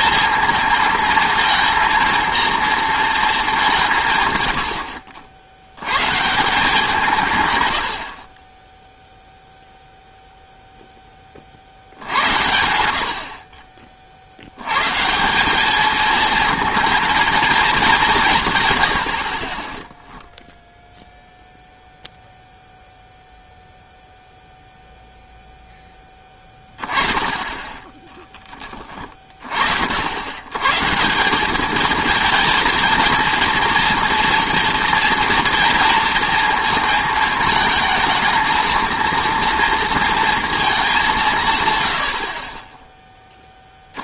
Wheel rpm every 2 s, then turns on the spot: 230, 230, 90, 170, 10, 0, 70, 100, 230, 140, 0, 0, 0, 20, 20, 120, 230, 240, 230, 230, 220, 30.
none